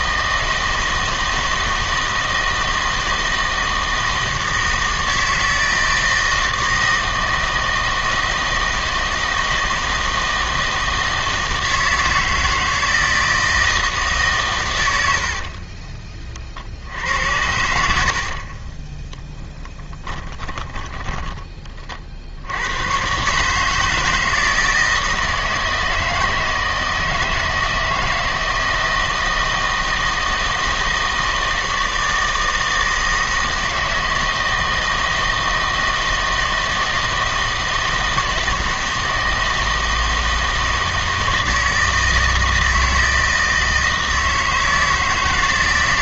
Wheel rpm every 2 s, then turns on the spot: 160, 160, 160, 160, 160, 160, 160, 90, 70, 20, 10, 110, 160, 160, 160, 160, 160, 160, 160, 160, 160, 160, 160.
16-22